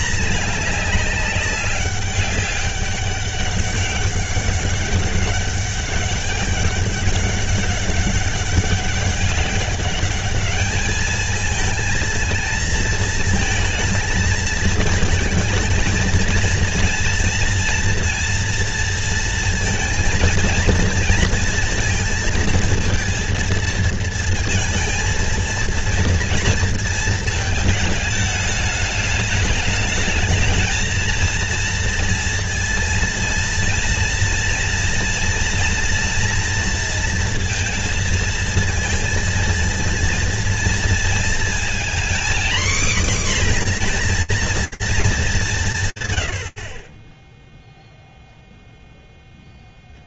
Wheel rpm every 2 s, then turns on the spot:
210, 200, 200, 200, 190, 210, 230, 220, 230, 230, 230, 230, 230, 230, 210, 220, 230, 240, 230, 230, 230, 250, 230, 30, 0.
none